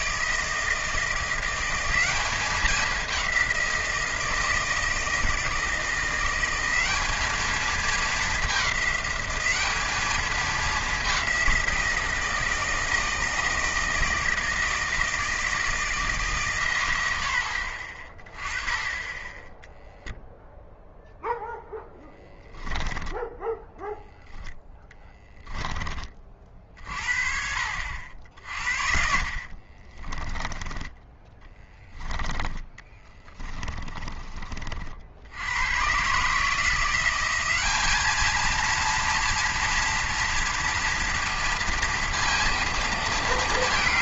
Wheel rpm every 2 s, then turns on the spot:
160, 200, 160, 190, 200, 210, 160, 160, 130, 20, 0, 10, 10, 50, 60, 10, 20, 40, 160, 230, 230, 230.
22-26 28-34